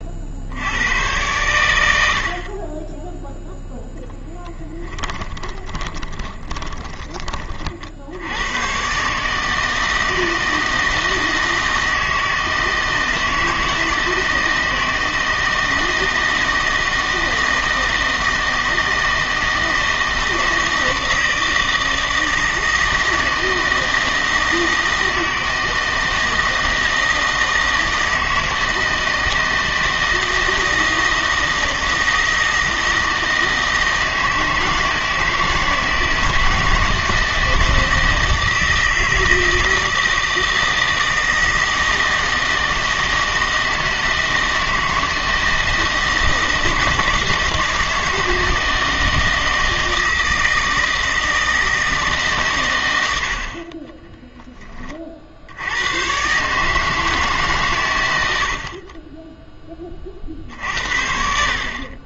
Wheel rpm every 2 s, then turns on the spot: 90, 30, 10, 10, 110, 160, 160, 160, 160, 160, 160, 160, 160, 160, 160, 160, 160, 160, 160, 160, 160, 160, 160, 160, 160, 160, 120, 20, 150, 50, 70.
4-8 58-60